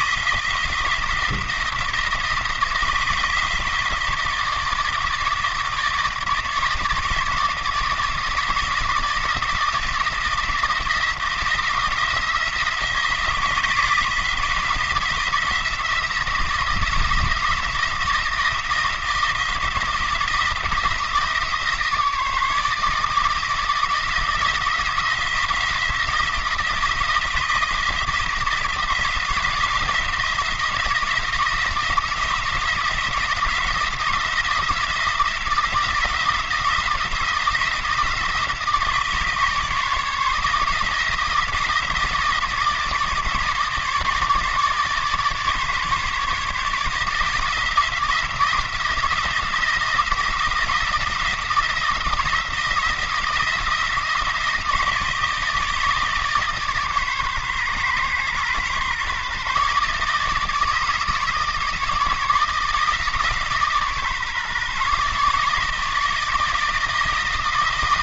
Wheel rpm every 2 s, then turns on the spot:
160, 160, 160, 160, 160, 170, 170, 170, 160, 160, 160, 160, 170, 170, 170, 170, 170, 170, 170, 160, 160, 160, 150, 160, 170, 160, 160, 160, 140, 130, 150, 160, 150, 160.
none